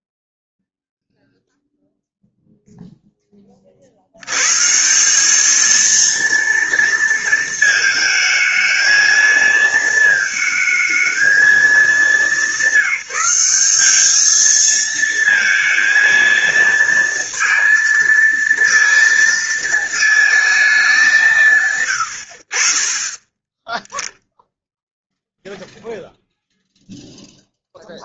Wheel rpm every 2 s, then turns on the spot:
0, 0, 130, 230, 220, 220, 210, 220, 230, 230, 220, 50, 0, 0.
none